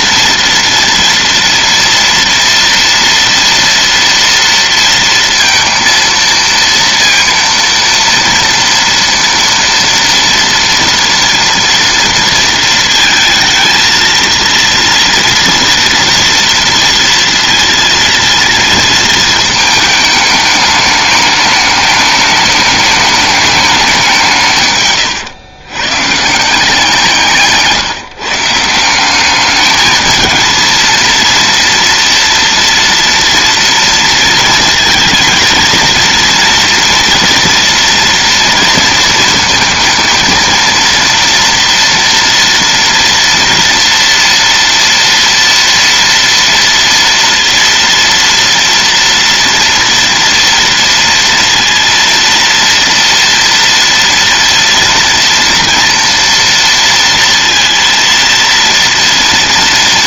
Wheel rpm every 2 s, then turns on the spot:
230, 230, 230, 230, 230, 230, 230, 230, 230, 230, 210, 210, 150, 160, 170, 230, 240, 230, 230, 230, 230, 230, 230, 230, 230, 230, 230, 230, 230, 230.
none